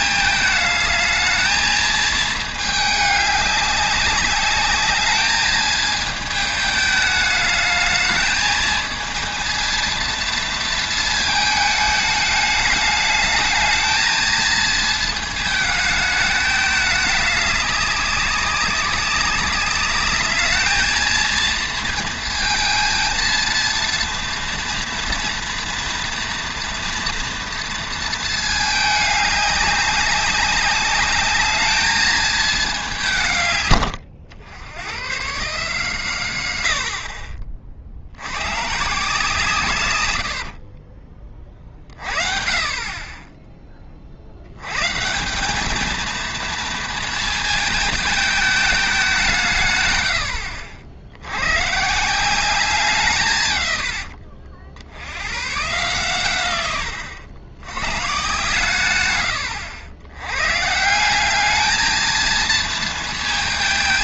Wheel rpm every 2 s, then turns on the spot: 220, 210, 210, 220, 220, 230, 220, 220, 210, 200, 220, 220, 230, 230, 220, 210, 200, 90, 90, 130, 50, 40, 120, 230, 210, 70, 190, 70, 110, 130, 140, 230.
40-42 56-58